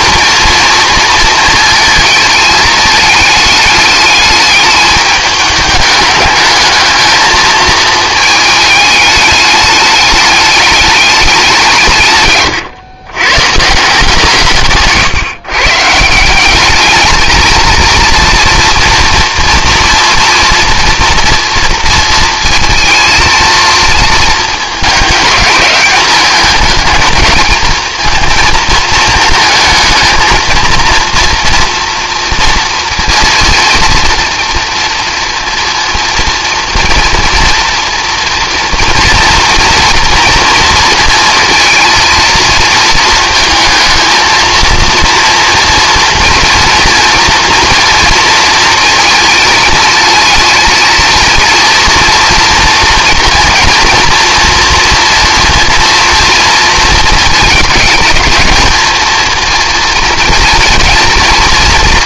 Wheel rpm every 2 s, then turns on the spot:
230, 220, 210, 210, 210, 200, 110, 150, 200, 230, 230, 230, 220, 210, 220, 230, 230, 230, 230, 230, 230, 230, 230, 240, 230, 230, 230, 240, 230, 230, 230.
none